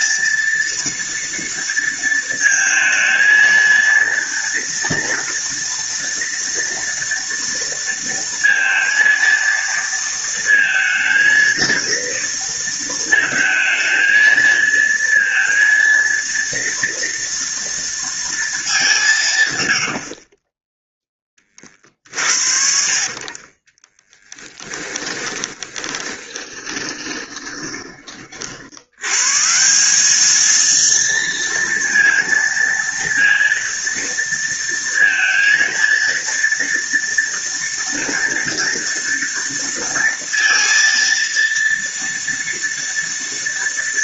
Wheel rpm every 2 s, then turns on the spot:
230, 220, 230, 230, 230, 230, 230, 230, 230, 190, 10, 40, 10, 20, 100, 230, 230, 230, 230, 230, 230, 230.
22-28